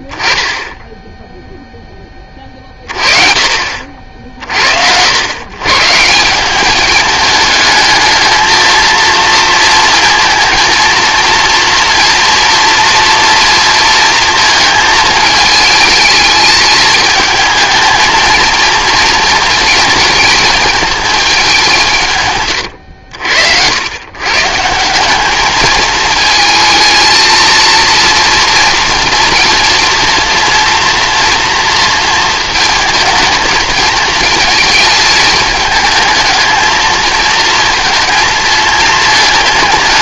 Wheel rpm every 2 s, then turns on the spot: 10, 30, 70, 210, 230, 230, 230, 220, 220, 230, 220, 90, 160, 220, 230, 230, 230, 220, 220, 220.
none